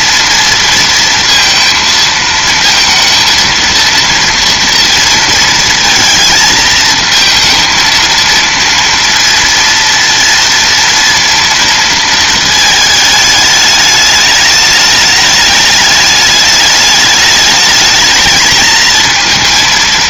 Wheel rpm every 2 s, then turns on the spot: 230, 230, 230, 220, 230, 230, 220, 210, 210, 230.
none